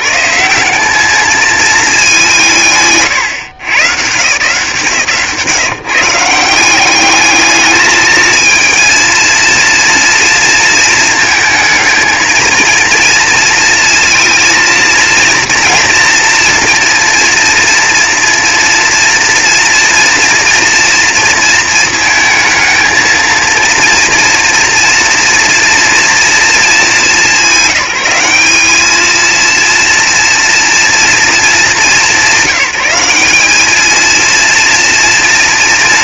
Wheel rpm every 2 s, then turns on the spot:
200, 150, 160, 210, 230, 220, 230, 230, 230, 230, 230, 220, 230, 220, 220, 230, 200, 230.
2-4